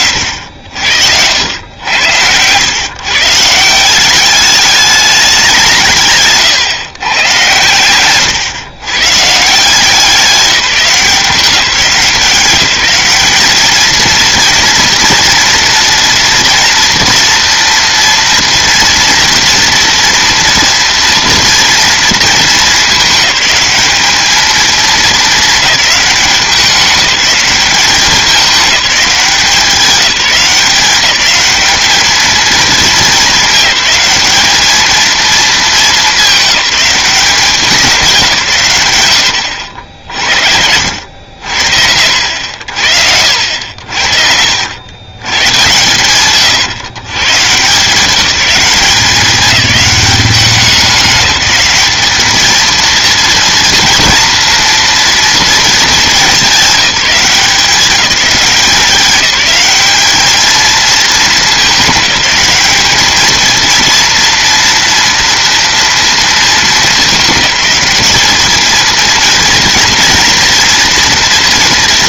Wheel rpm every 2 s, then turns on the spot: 80, 130, 210, 130, 130, 180, 170, 230, 240, 230, 230, 220, 220, 200, 200, 190, 220, 220, 190, 120, 80, 70, 90, 130, 200, 200, 220, 230, 200, 190, 220, 210, 230, 210, 220, 240.
none